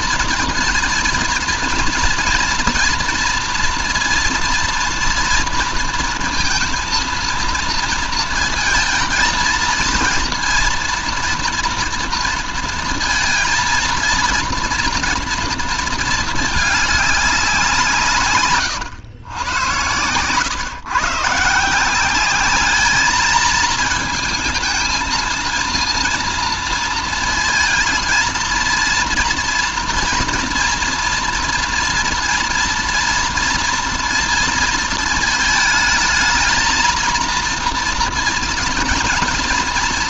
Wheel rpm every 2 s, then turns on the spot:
230, 240, 230, 230, 230, 230, 230, 230, 210, 130, 120, 200, 220, 230, 230, 230, 230, 230, 230, 230.
none